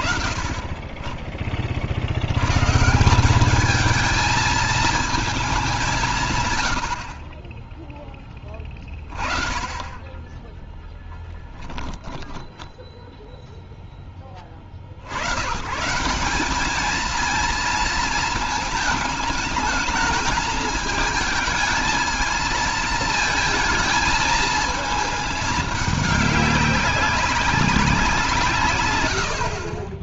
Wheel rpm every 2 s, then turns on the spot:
20, 150, 230, 80, 20, 30, 10, 50, 210, 220, 220, 230, 220, 190, 130.
10-14